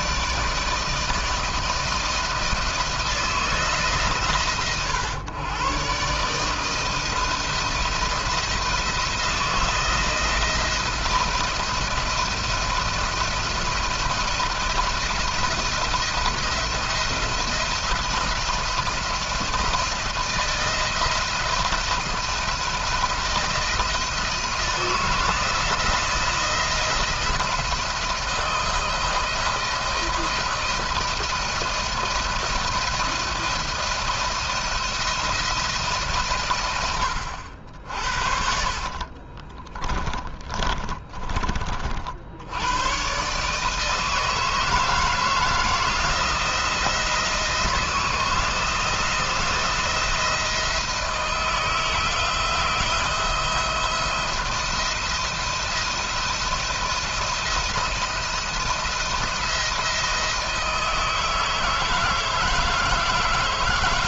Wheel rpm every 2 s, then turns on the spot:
160, 160, 120, 160, 170, 170, 170, 170, 170, 170, 170, 170, 160, 170, 170, 170, 170, 170, 110, 50, 30, 100, 160, 170, 160, 160, 170, 170, 170, 170, 160, 160.
38-42